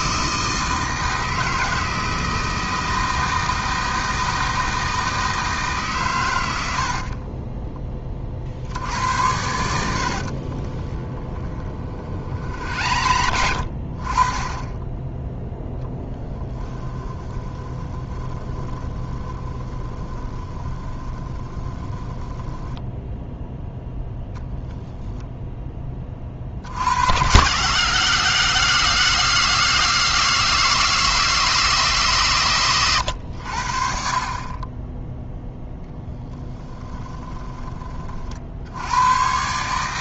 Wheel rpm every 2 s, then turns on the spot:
160, 160, 160, 70, 70, 30, 60, 20, 10, 20, 20, 10, 10, 70, 160, 160, 120, 20, 20, 80.
10-14 16-24 36-38